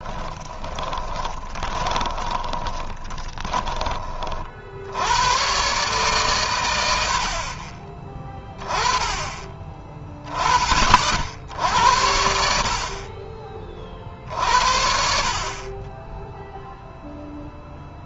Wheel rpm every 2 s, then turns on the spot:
20, 20, 70, 100, 20, 50, 50, 60, 0.
0-4